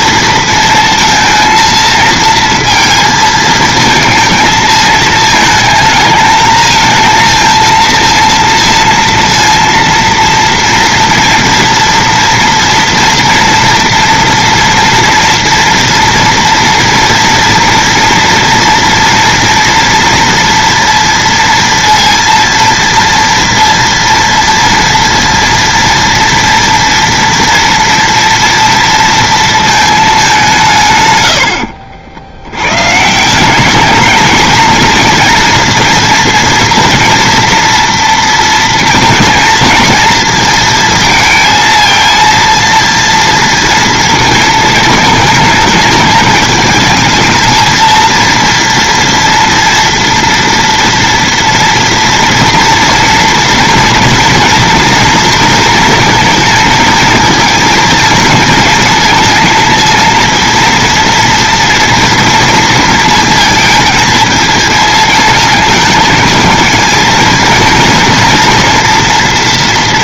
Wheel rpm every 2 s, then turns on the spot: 230, 230, 220, 230, 230, 230, 230, 230, 230, 230, 230, 230, 230, 230, 220, 60, 200, 230, 240, 230, 230, 230, 220, 220, 230, 230, 230, 230, 220, 230, 230, 220, 220, 230, 230.
30-32